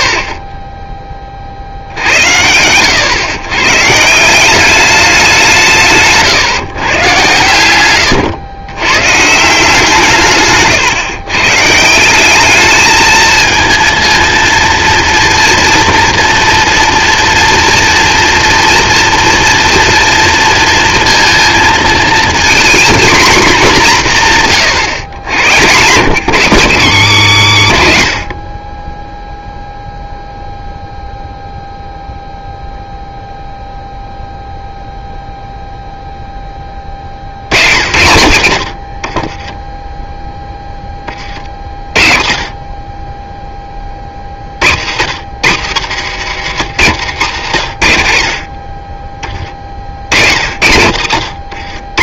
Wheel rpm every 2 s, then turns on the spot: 60, 90, 190, 140, 120, 140, 210, 230, 230, 230, 230, 240, 140, 160, 40, 0, 0, 0, 20, 100, 10, 40, 50, 130, 50, 80.
10-12